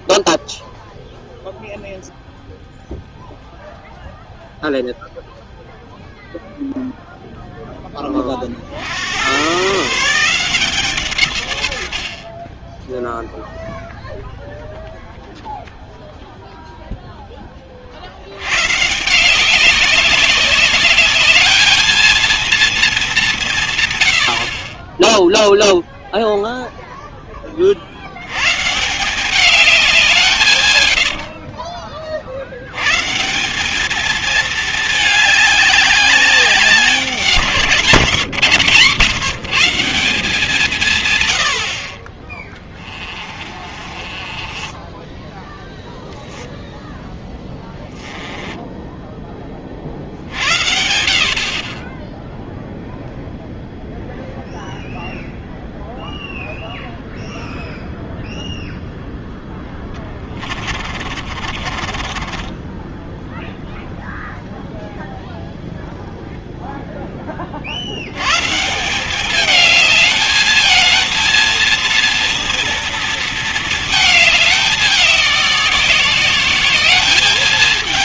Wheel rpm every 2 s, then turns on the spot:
0, 0, 0, 0, 70, 150, 10, 0, 0, 140, 200, 200, 30, 0, 140, 120, 100, 210, 180, 150, 150, 20, 20, 0, 10, 70, 0, 0, 0, 0, 40, 20, 0, 0, 170, 220, 230, 200, 200.
30-32 42-46 48-50 60-64